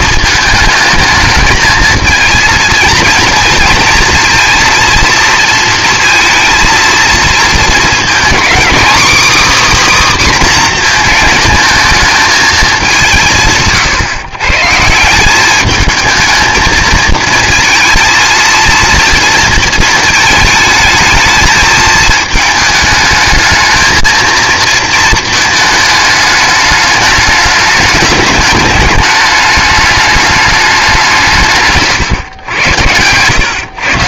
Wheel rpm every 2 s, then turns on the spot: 220, 230, 230, 230, 260, 250, 220, 150, 220, 230, 220, 220, 230, 210, 210, 200, 100.
none